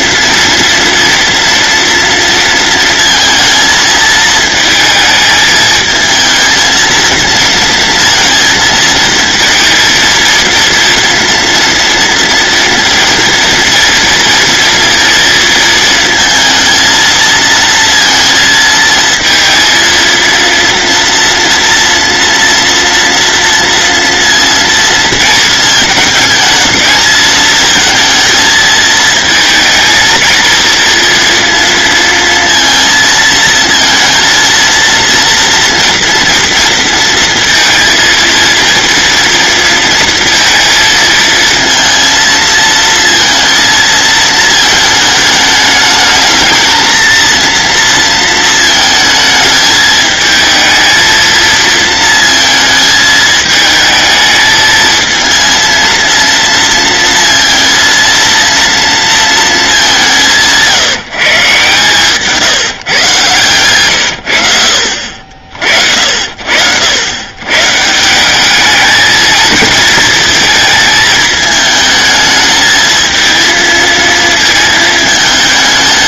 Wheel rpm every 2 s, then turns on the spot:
240, 230, 220, 220, 230, 230, 230, 230, 220, 220, 230, 230, 230, 220, 220, 230, 230, 230, 230, 230, 230, 230, 210, 220, 220, 220, 220, 220, 230, 230, 170, 140, 80, 80, 220, 220, 220, 220.
none